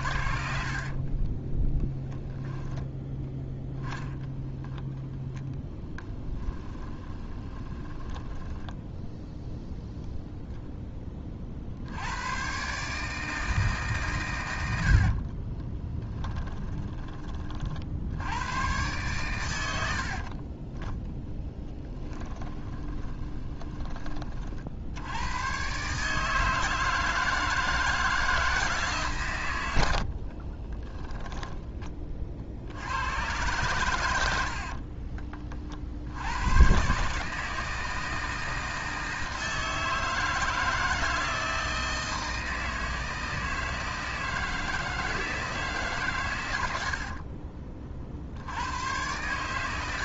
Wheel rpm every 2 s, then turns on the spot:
50, 10, 0, 20, 10, 10, 140, 70, 20, 110, 10, 20, 70, 160, 150, 20, 80, 50, 130, 160, 160, 160, 160, 70, 100.
0-2 6-10 20-24 30-32 34-36